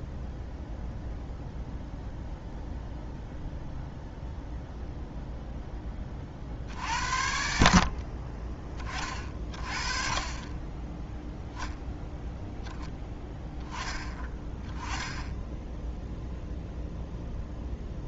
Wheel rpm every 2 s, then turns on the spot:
0, 0, 0, 60, 30, 10, 0, 10, 0.
none